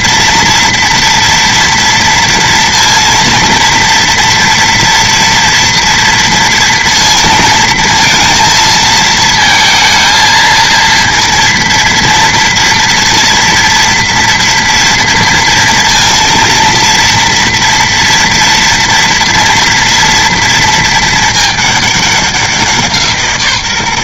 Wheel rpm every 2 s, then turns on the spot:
230, 230, 230, 230, 230, 230, 230, 230, 230, 230, 220, 170.
none